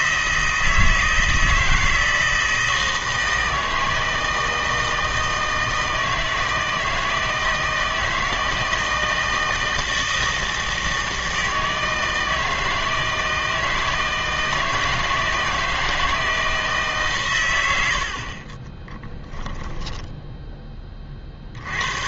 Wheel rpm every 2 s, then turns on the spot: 160, 160, 160, 160, 160, 160, 160, 160, 160, 20, 20.
18-20